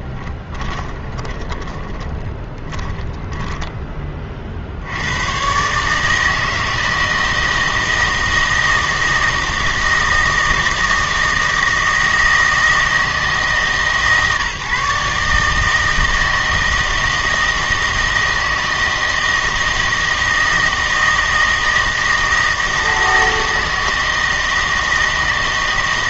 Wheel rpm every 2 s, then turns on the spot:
20, 20, 60, 160, 160, 160, 160, 150, 160, 160, 160, 160, 160.
0-4